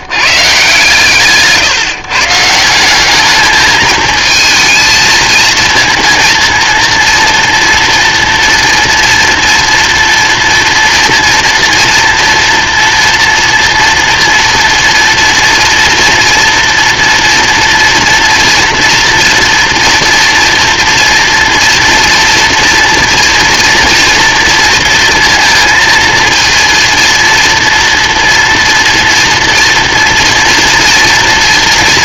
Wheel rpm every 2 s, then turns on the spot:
130, 160, 220, 230, 240, 240, 230, 230, 230, 230, 230, 240, 230, 230, 230, 230.
none